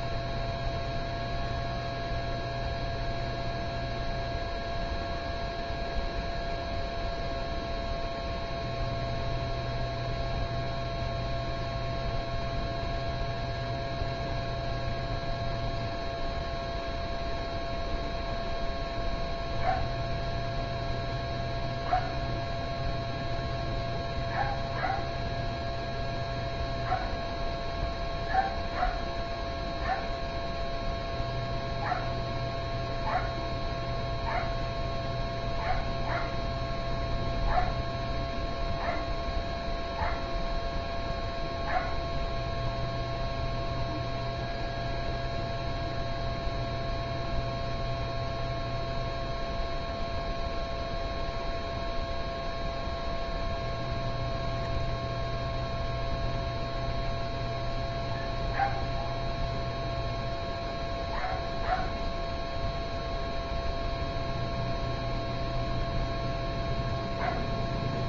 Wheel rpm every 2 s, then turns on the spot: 0, 0, 0, 0, 0, 0, 0, 0, 0, 0, 0, 0, 0, 0, 0, 0, 0, 0, 0, 0, 0, 0, 0, 0, 0, 0, 0, 0, 0, 0, 0, 0, 0, 0.
none